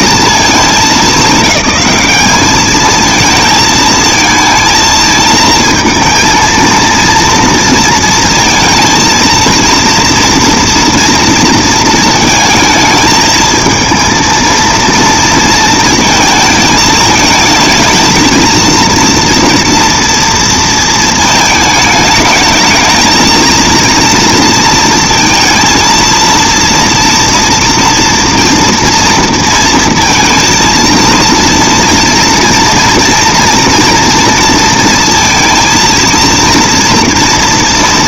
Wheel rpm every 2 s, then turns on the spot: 210, 220, 230, 230, 230, 220, 220, 230, 220, 230, 220, 230, 230, 230, 230, 230, 240, 230, 240.
none